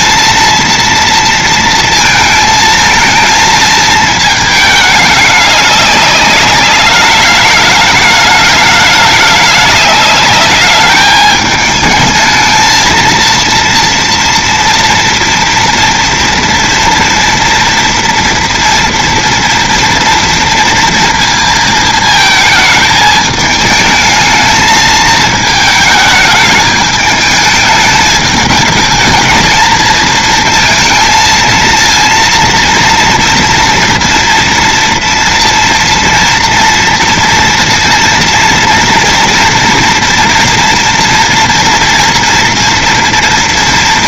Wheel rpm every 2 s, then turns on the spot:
230, 220, 220, 210, 210, 210, 220, 230, 230, 230, 230, 220, 220, 210, 220, 230, 230, 230, 240, 230, 240, 230.
none